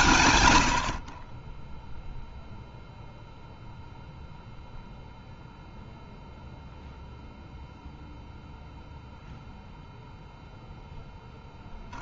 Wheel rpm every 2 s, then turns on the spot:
80, 0, 0, 0, 0, 10.
none